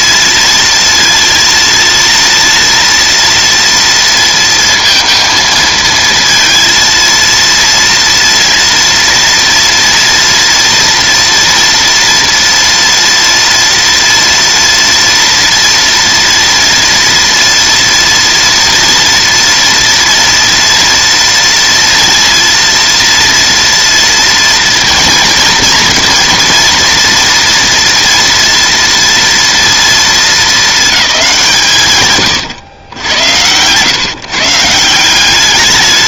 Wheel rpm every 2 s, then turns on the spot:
230, 230, 230, 230, 230, 230, 230, 230, 230, 230, 230, 230, 230, 230, 230, 220, 110, 150.
none